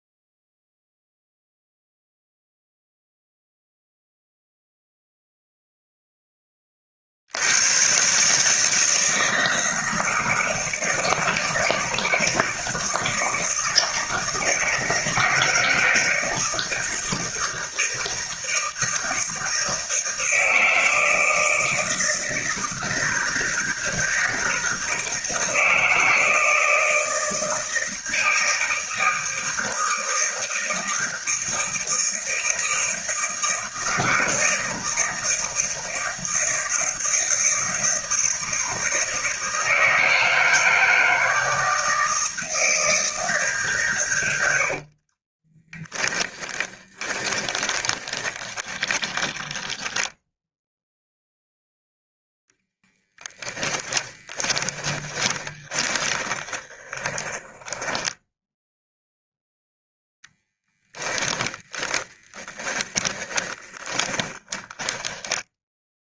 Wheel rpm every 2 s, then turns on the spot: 0, 0, 0, 40, 160, 160, 160, 160, 160, 160, 160, 160, 160, 160, 160, 160, 160, 160, 160, 160, 160, 160, 60, 20, 30, 0, 10, 20, 20, 0, 10, 20, 10.
44-50 54-58 60-66